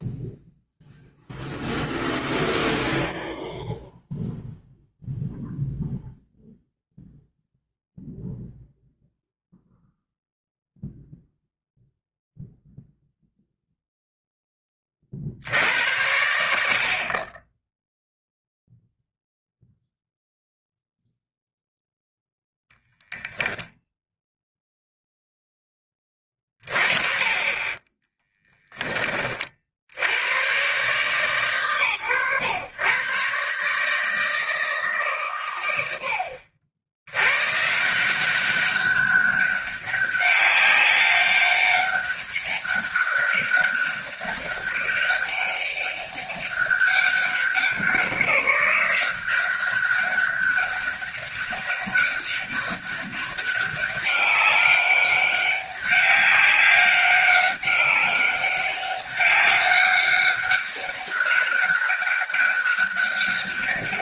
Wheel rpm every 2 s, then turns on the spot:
0, 0, 0, 0, 0, 0, 0, 20, 60, 0, 0, 0, 0, 30, 10, 130, 120, 160, 80, 200, 200, 200, 200, 200, 180, 200, 200, 200, 190, 200, 200, 200.
none